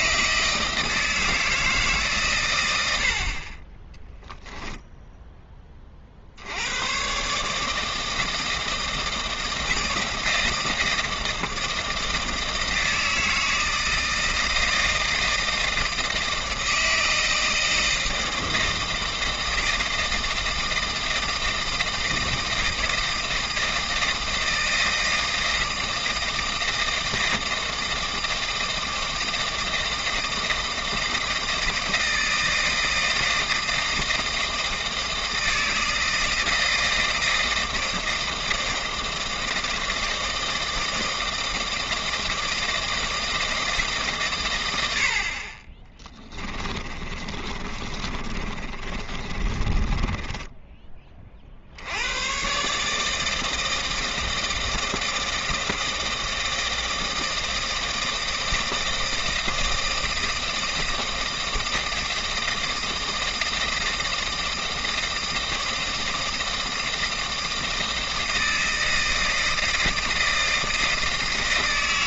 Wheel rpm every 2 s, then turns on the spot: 160, 110, 0, 90, 160, 160, 160, 160, 160, 160, 160, 160, 160, 160, 160, 160, 160, 160, 160, 160, 160, 160, 110, 20, 30, 10, 130, 160, 160, 160, 160, 160, 160, 160, 160, 160.
46-52